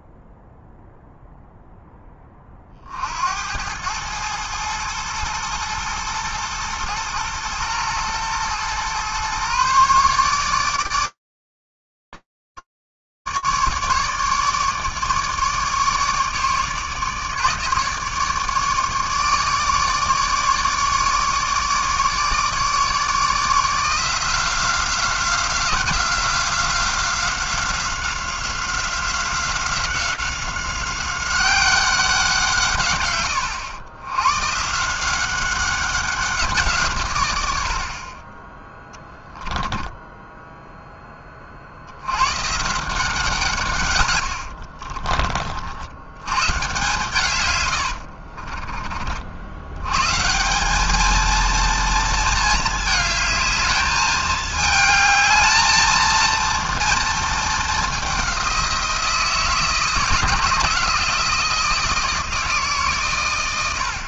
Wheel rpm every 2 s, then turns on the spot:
0, 20, 110, 120, 120, 150, 150, 150, 150, 150, 150, 150, 170, 180, 180, 190, 160, 120, 180, 20, 0, 110, 80, 110, 50, 160, 220, 220, 230, 190, 170, 160.
44-46 48-50